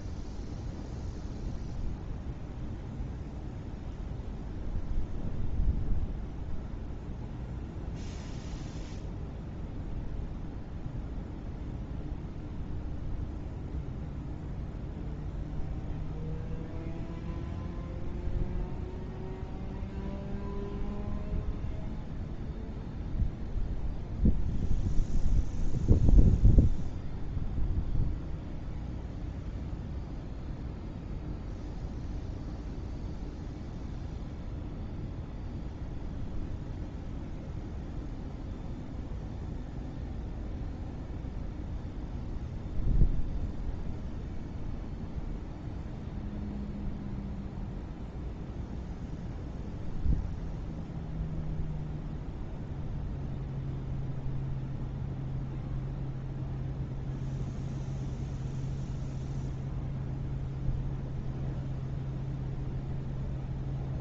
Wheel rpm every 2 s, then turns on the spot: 0, 0, 0, 0, 0, 0, 0, 0, 0, 0, 0, 0, 0, 0, 0, 0, 0, 0, 0, 0, 0, 0, 0, 0, 0, 0, 0, 0, 0, 0, 0, 0.
none